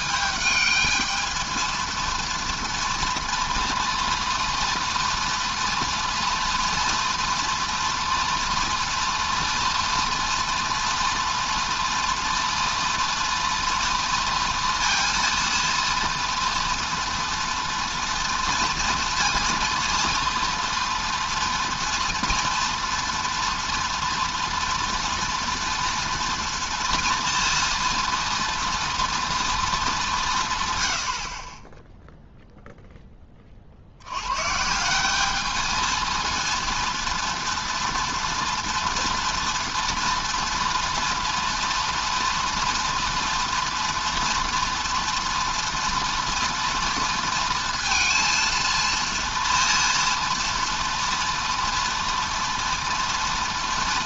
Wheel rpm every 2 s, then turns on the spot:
220, 230, 230, 230, 230, 230, 230, 230, 230, 230, 230, 230, 230, 230, 230, 110, 0, 150, 230, 230, 230, 230, 240, 230, 230, 230, 240.
none